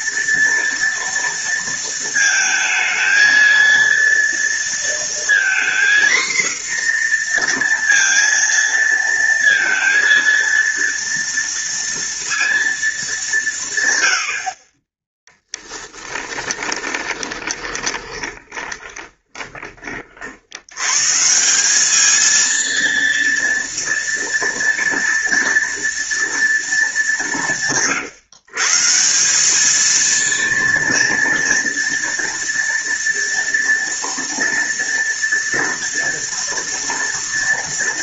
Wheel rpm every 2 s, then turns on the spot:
230, 230, 230, 240, 230, 230, 180, 10, 20, 20, 150, 230, 230, 190, 180, 230, 230, 230, 220.
14-20